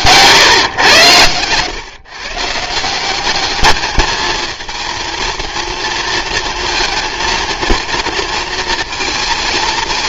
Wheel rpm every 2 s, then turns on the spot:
120, 170, 230, 230, 230.
none